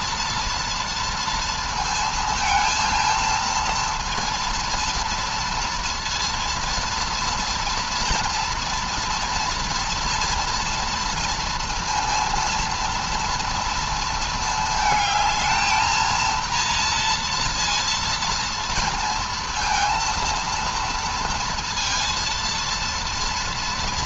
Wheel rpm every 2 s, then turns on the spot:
230, 220, 230, 230, 230, 230, 230, 220, 230, 230, 230, 230.
none